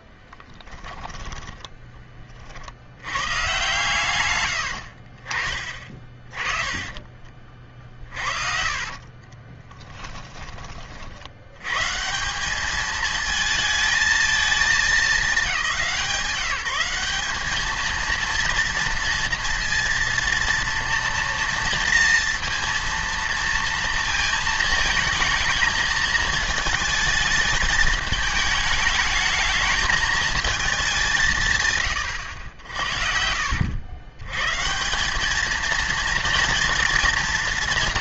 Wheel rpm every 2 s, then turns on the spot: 10, 70, 90, 20, 40, 40, 200, 220, 180, 230, 230, 230, 220, 220, 210, 210, 90, 140, 230.
0-2 4-10